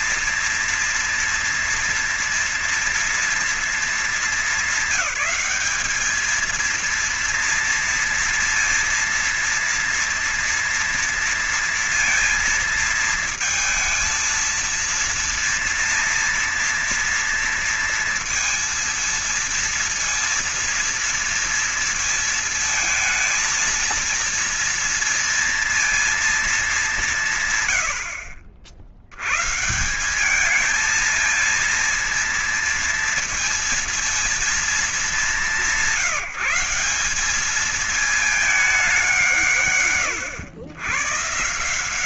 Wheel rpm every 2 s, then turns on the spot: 240, 230, 220, 200, 230, 230, 230, 220, 230, 230, 230, 230, 230, 230, 110, 150, 230, 230, 180, 210, 160.
none